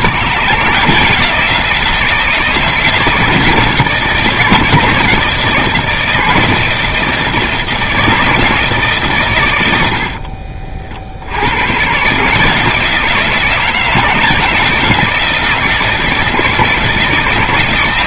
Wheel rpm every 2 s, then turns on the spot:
170, 170, 160, 160, 150, 50, 160, 170, 160.
none